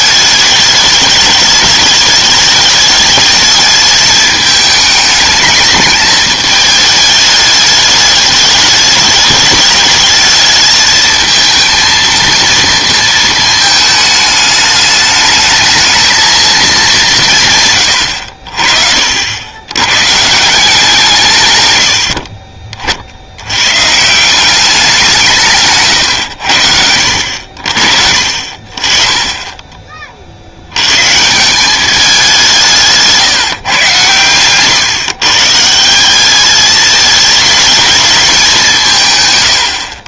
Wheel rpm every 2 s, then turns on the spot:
210, 210, 210, 210, 210, 220, 230, 210, 210, 40, 170, 50, 190, 70, 40, 100, 170, 120, 210, 170.
none